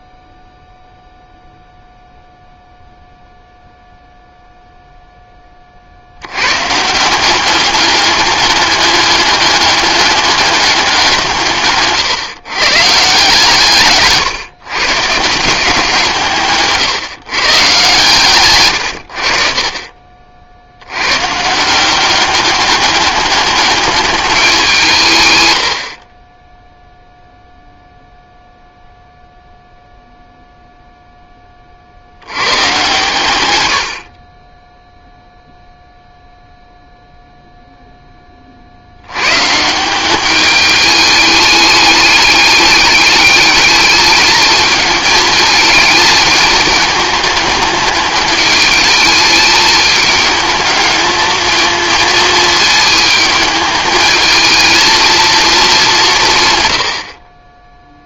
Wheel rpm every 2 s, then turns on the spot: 0, 0, 0, 90, 200, 200, 140, 140, 150, 120, 50, 190, 200, 30, 0, 0, 90, 40, 0, 20, 200, 210, 220, 220, 210, 210, 220, 220, 160.
18-20